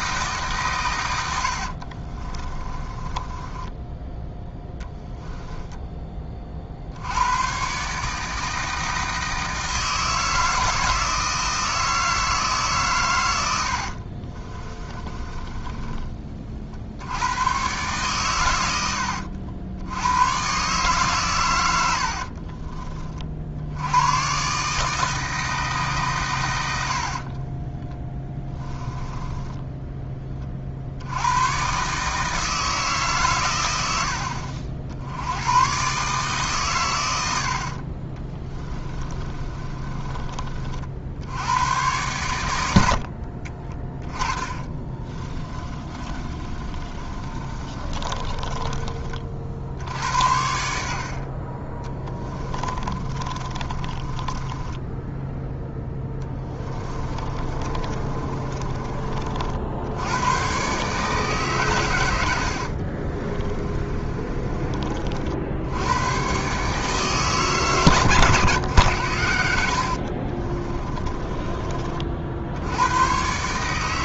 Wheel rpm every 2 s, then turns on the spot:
130, 20, 10, 50, 160, 160, 140, 20, 50, 90, 140, 30, 150, 90, 10, 60, 150, 80, 110, 20, 50, 70, 30, 30, 30, 80, 30, 10, 20, 30, 140, 50, 40, 150, 110, 30, 70.
2-4 14-16 28-30 38-40 42-48 52-58 62-64 68-72